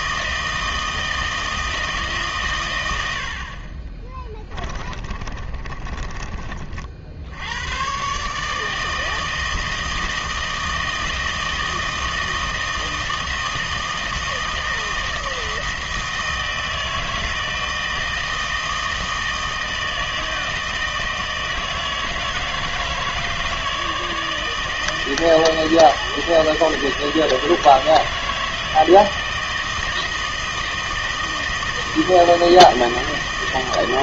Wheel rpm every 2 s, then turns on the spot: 160, 130, 30, 40, 150, 160, 160, 160, 160, 160, 160, 160, 160, 160, 160, 160, 160.
4-6